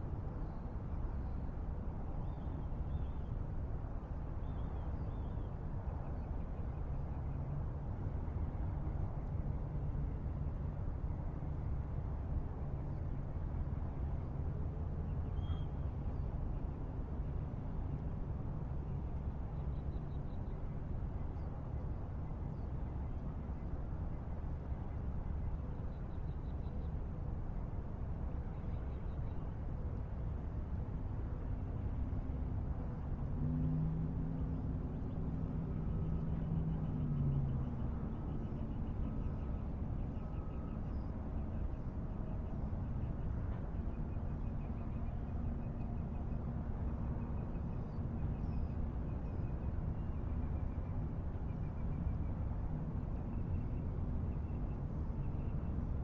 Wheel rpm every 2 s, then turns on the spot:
0, 0, 0, 0, 0, 0, 0, 0, 0, 0, 0, 0, 0, 0, 0, 0, 0, 0, 0, 0, 0, 0, 0, 0, 0, 0, 0, 0.
none